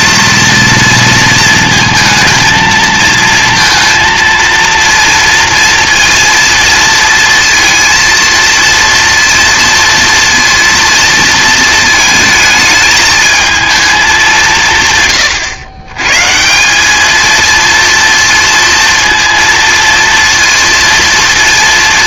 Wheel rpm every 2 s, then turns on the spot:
230, 230, 230, 230, 230, 230, 220, 170, 170, 230, 230.
none